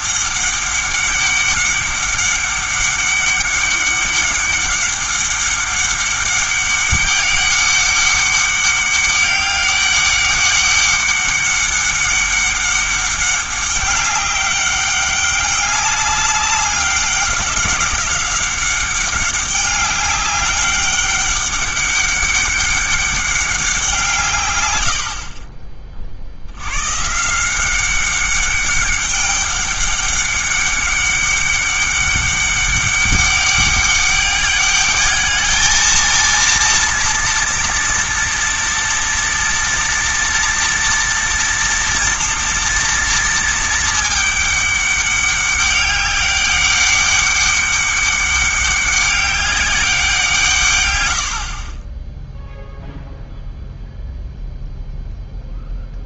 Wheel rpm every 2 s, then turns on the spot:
200, 200, 200, 200, 200, 200, 200, 200, 200, 200, 200, 200, 90, 110, 200, 200, 200, 210, 230, 240, 230, 230, 200, 200, 200, 130, 0, 0.
none